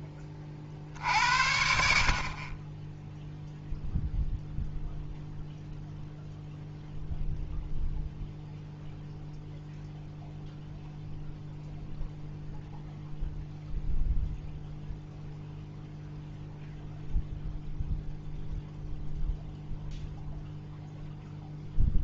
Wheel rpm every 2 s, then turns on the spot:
50, 20, 0, 0, 0, 0, 0, 0, 0, 0, 0.
none